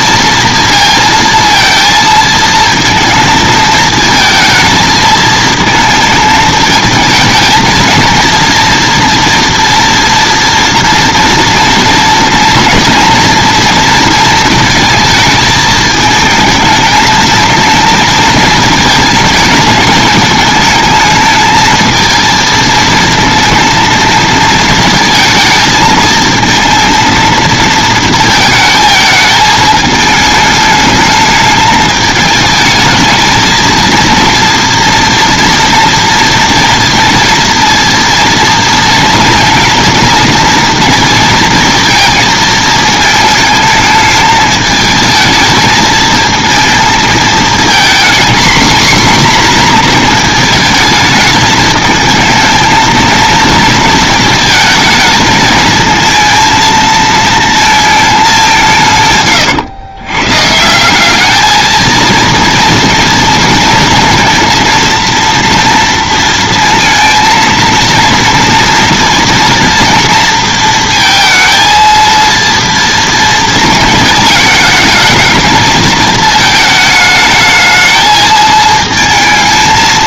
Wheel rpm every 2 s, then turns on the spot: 230, 220, 220, 220, 230, 230, 230, 230, 230, 220, 220, 230, 230, 220, 220, 210, 220, 230, 230, 230, 230, 220, 220, 220, 240, 220, 220, 220, 230, 180, 160, 230, 230, 230, 230, 230, 230, 220, 220, 220.
none